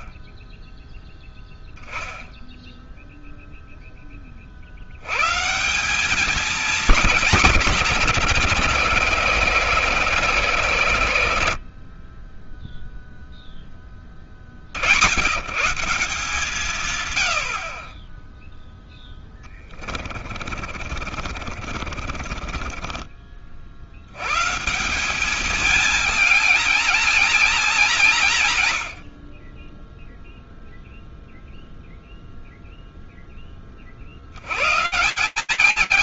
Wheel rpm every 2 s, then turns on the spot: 0, 0, 70, 220, 140, 140, 10, 50, 150, 10, 50, 30, 150, 220, 130, 0, 0, 140.
20-24